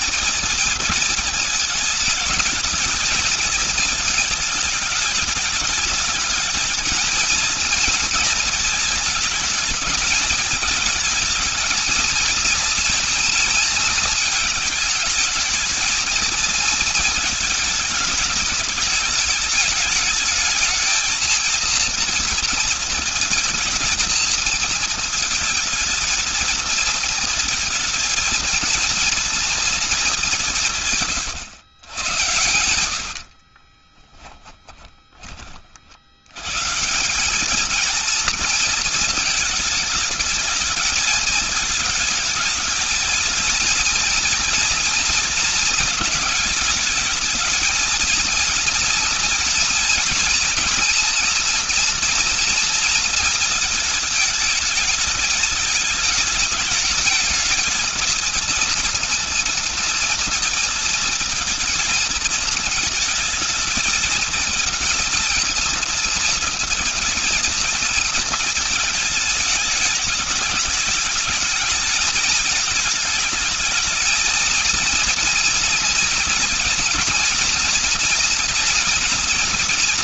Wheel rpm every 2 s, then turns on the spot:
230, 210, 210, 220, 220, 220, 230, 210, 220, 220, 220, 230, 230, 230, 230, 170, 100, 10, 130, 230, 210, 220, 230, 220, 230, 240, 230, 220, 220, 230, 230, 230, 230, 220, 220, 210, 220, 230, 230, 240.
32-36